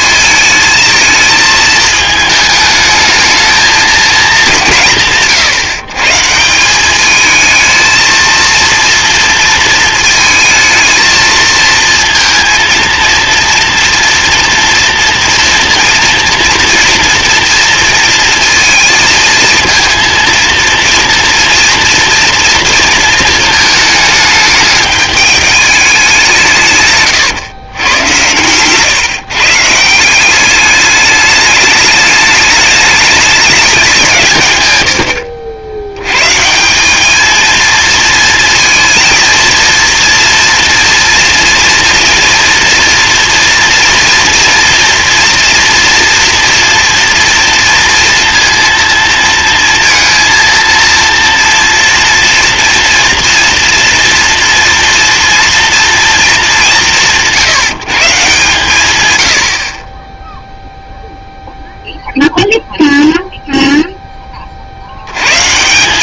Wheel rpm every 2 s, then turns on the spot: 220, 220, 180, 190, 230, 220, 230, 230, 230, 230, 230, 230, 210, 160, 120, 200, 210, 130, 150, 230, 230, 240, 230, 230, 230, 230, 230, 230, 200, 140, 0, 0, 40.
28-30